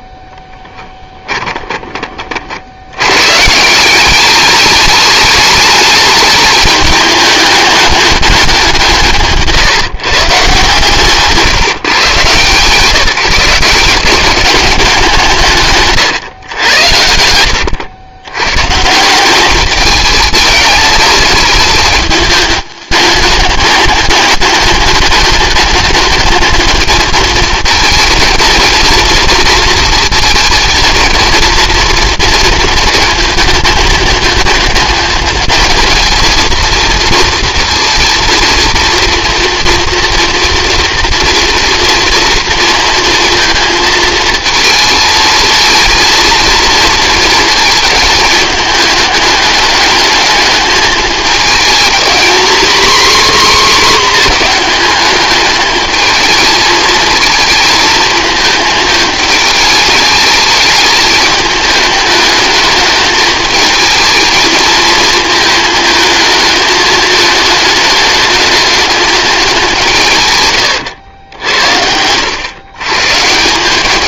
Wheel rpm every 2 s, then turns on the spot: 10, 100, 210, 210, 180, 140, 150, 190, 90, 160, 210, 210, 200, 220, 230, 220, 230, 220, 230, 230, 230, 230, 220, 230, 210, 210, 260, 220, 220, 220, 220, 220, 220, 220, 210, 110, 140.
0-2